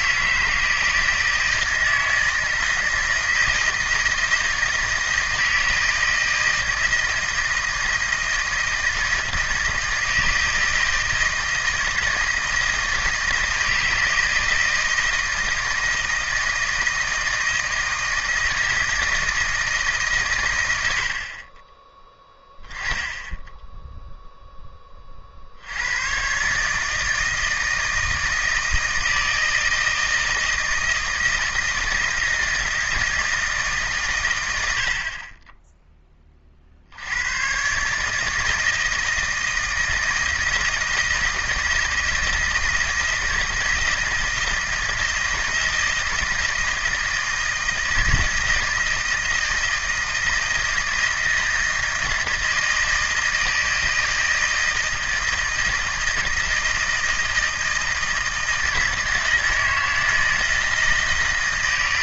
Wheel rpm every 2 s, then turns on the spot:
160, 160, 160, 160, 160, 160, 160, 160, 160, 160, 100, 10, 10, 140, 160, 160, 160, 90, 40, 160, 170, 160, 160, 160, 160, 160, 160, 160, 160, 160, 160.
none